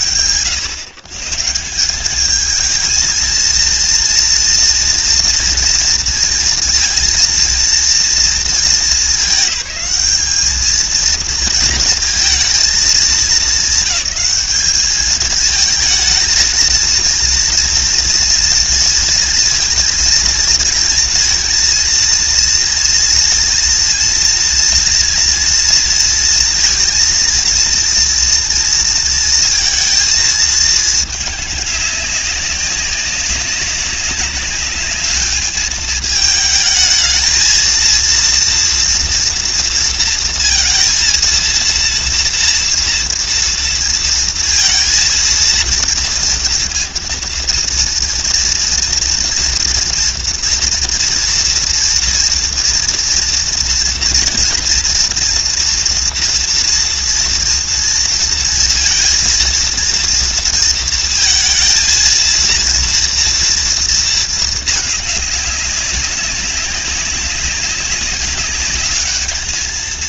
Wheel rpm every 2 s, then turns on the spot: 140, 220, 240, 230, 210, 220, 210, 210, 230, 230, 230, 230, 230, 230, 230, 210, 200, 210, 220, 230, 230, 230, 230, 230, 230, 230, 240, 240, 230, 230, 230, 230, 200, 200, 210.
none